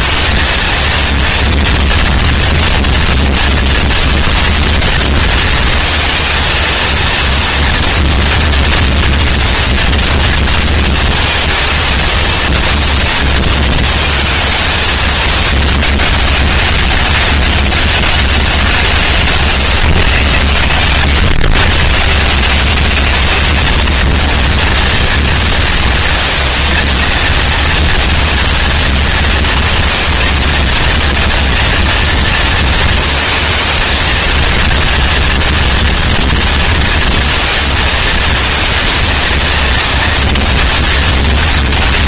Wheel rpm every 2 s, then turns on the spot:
220, 230, 230, 230, 230, 230, 230, 230, 210, 200, 110, 150, 230, 230, 230, 230, 230, 220, 230, 220, 230.
none